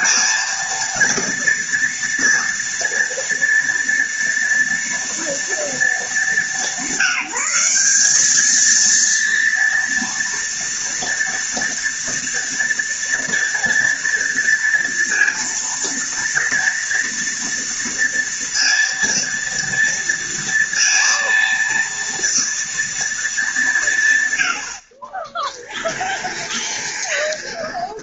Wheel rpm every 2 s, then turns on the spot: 230, 230, 230, 180, 230, 230, 230, 230, 240, 230, 230, 230, 50, 20.
26-28